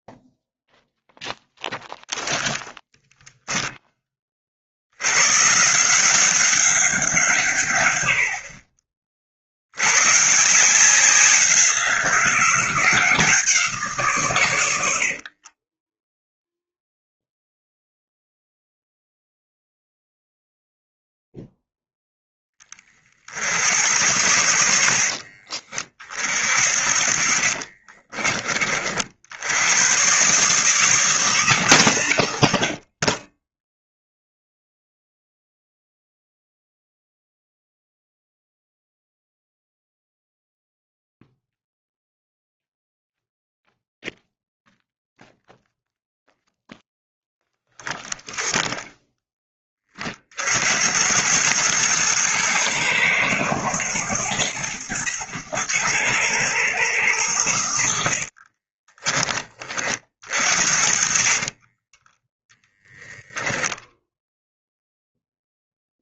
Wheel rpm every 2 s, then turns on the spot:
0, 0, 90, 190, 50, 180, 180, 80, 0, 0, 0, 40, 70, 40, 50, 160, 50, 0, 0, 0, 0, 0, 0, 0, 0, 80, 110, 110, 90, 20, 50, 0, 0.
14-16 26-28 58-62